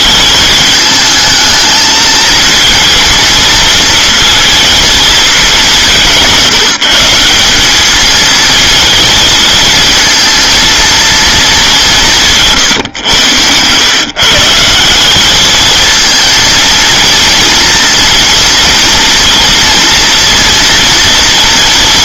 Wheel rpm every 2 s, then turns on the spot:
220, 230, 220, 170, 220, 230, 130, 180, 230, 230, 240.
none